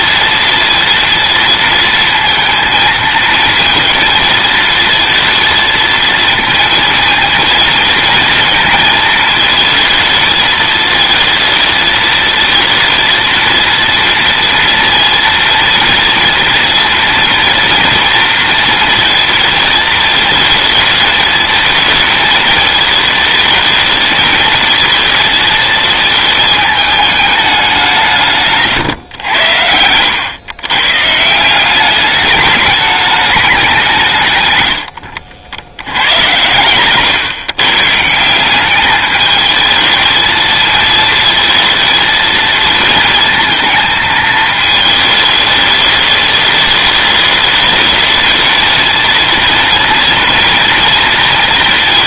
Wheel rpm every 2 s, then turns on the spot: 230, 230, 230, 230, 220, 220, 230, 230, 230, 230, 220, 220, 220, 220, 130, 140, 210, 100, 120, 200, 230, 230, 220, 210, 230, 230.
34-36